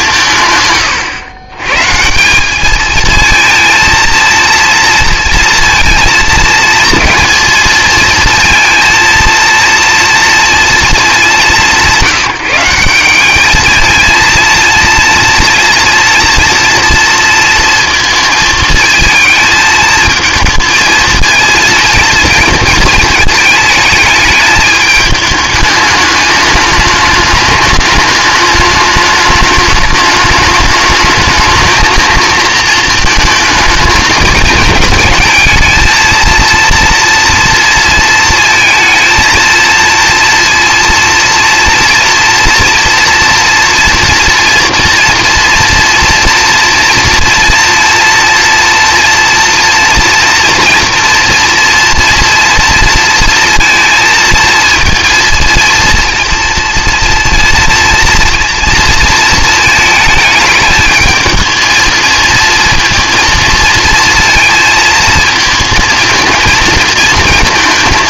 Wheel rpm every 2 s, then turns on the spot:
130, 210, 230, 230, 230, 230, 180, 230, 230, 220, 220, 230, 210, 210, 210, 210, 230, 220, 230, 220, 230, 240, 230, 230, 230, 230, 230, 230, 230, 230, 220, 230, 230, 220.
none